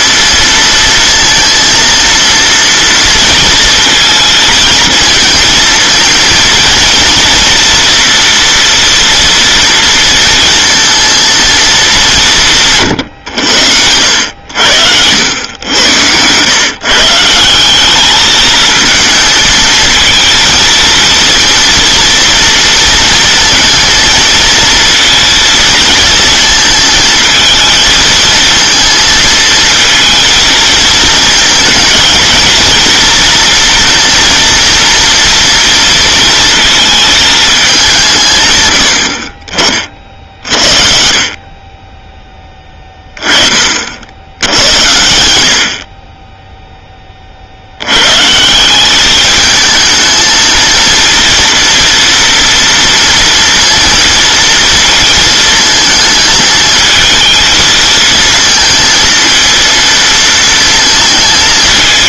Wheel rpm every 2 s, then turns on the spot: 230, 230, 230, 230, 230, 230, 160, 80, 130, 220, 230, 230, 230, 220, 230, 220, 230, 230, 230, 120, 50, 10, 90, 10, 180, 230, 230, 230, 220, 230, 220.
none